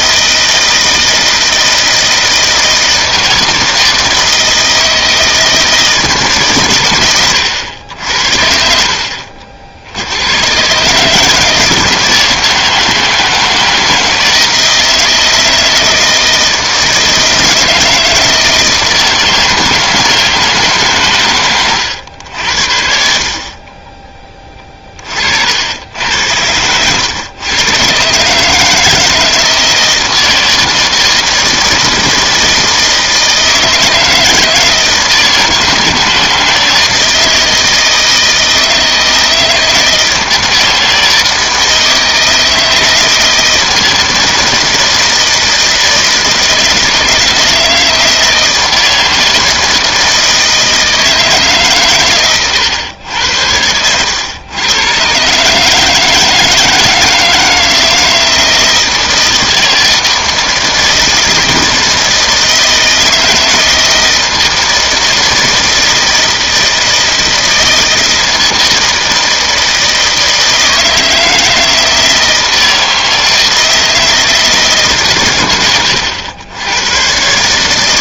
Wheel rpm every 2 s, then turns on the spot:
160, 160, 160, 130, 60, 130, 160, 160, 160, 160, 150, 70, 20, 100, 150, 160, 160, 160, 160, 160, 160, 160, 160, 160, 160, 160, 120, 110, 160, 160, 160, 160, 160, 160, 160, 160, 160, 150, 90.
none